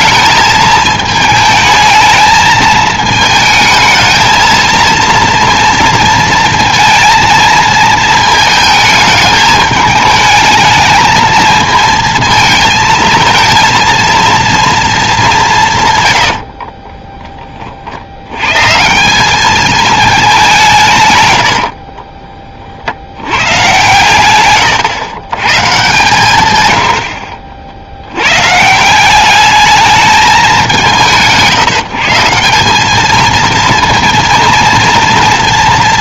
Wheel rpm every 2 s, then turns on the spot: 220, 220, 220, 230, 220, 220, 220, 230, 50, 130, 170, 50, 100, 120, 150, 190, 190, 230.
16-18